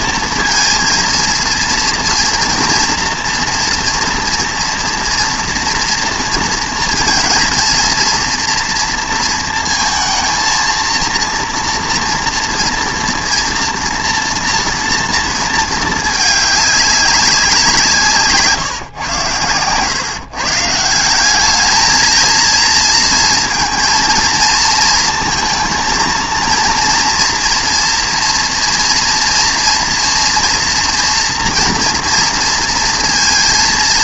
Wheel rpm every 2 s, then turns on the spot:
230, 230, 240, 230, 230, 230, 230, 240, 200, 140, 150, 230, 230, 230, 230, 230, 230.
none